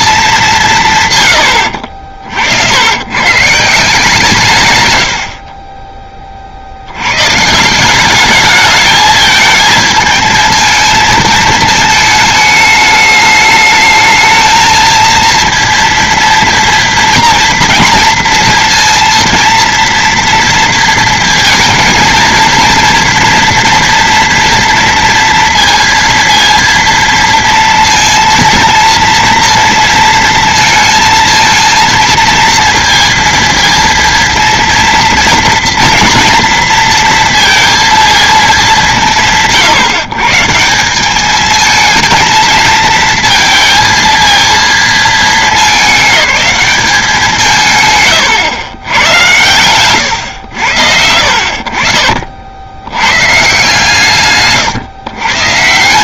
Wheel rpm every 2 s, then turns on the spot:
170, 80, 120, 70, 210, 220, 210, 220, 230, 230, 230, 230, 230, 230, 230, 220, 230, 230, 230, 200, 160, 230, 230, 200, 110, 90, 80, 130.
none